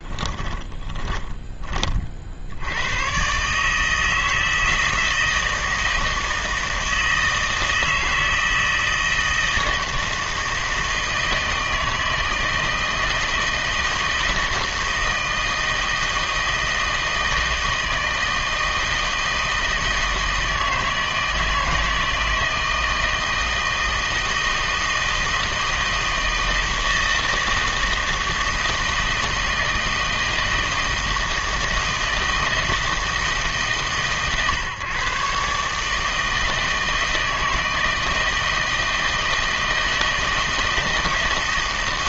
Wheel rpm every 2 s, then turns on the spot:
20, 80, 160, 160, 160, 160, 160, 160, 160, 160, 160, 160, 160, 160, 160, 160, 160, 130, 160, 160, 160.
0-2